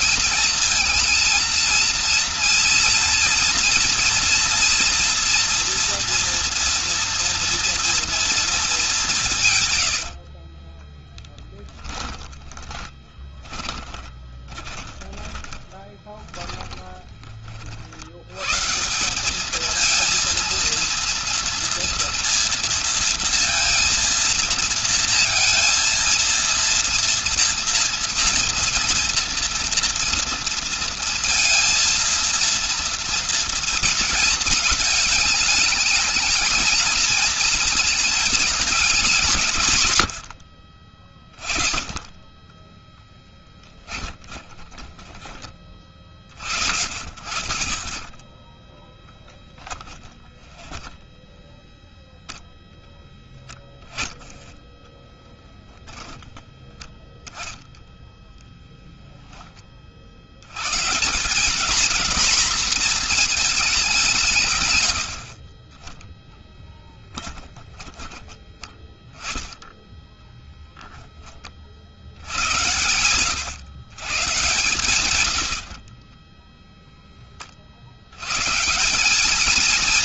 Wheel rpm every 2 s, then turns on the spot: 230, 230, 230, 230, 200, 20, 20, 20, 20, 160, 230, 230, 230, 230, 230, 230, 230, 220, 230, 210, 30, 10, 20, 40, 10, 10, 10, 0, 10, 10, 150, 240, 110, 10, 10, 10, 110, 120, 10, 160.
10-18 42-46 50-52 64-68